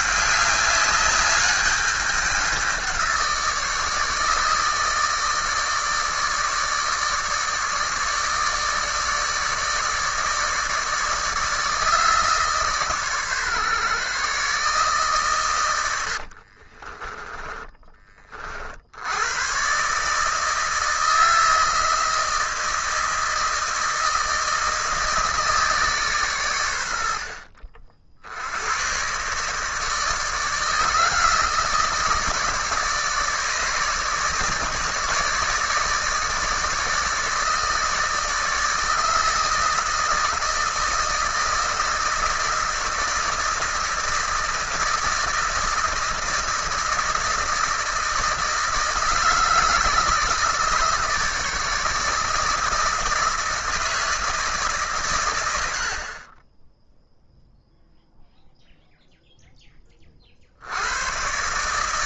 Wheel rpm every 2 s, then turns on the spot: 200, 180, 150, 160, 160, 160, 140, 130, 30, 70, 160, 160, 160, 80, 110, 160, 150, 150, 160, 160, 160, 160, 160, 160, 160, 160, 160, 140, 10, 0, 90.
16-18 26-28